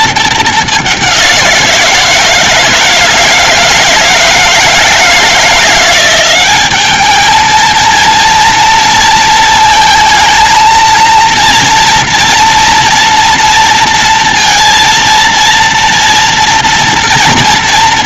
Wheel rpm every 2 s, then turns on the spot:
190, 160, 160, 210, 230, 220, 240, 230, 230.
none